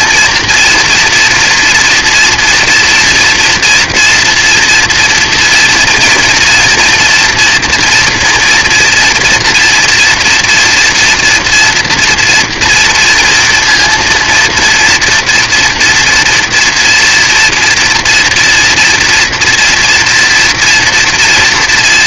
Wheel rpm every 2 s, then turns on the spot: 240, 230, 230, 230, 230, 240, 230, 230, 230, 240, 230.
none